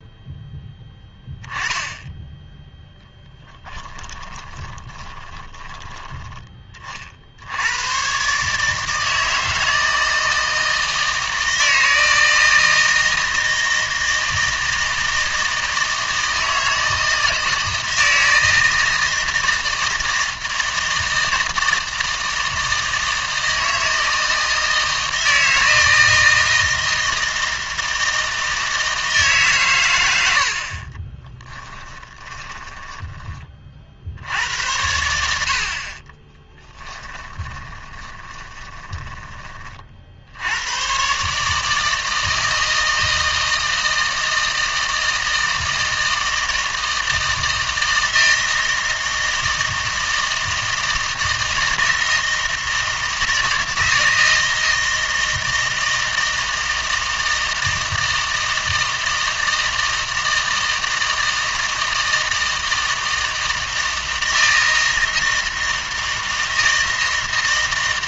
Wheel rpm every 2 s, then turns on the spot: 10, 0, 10, 30, 150, 160, 160, 160, 160, 160, 160, 160, 160, 160, 160, 30, 30, 100, 10, 10, 110, 160, 160, 160, 160, 160, 160, 160, 160, 160, 160, 160, 160, 160.
4-6 30-34 36-40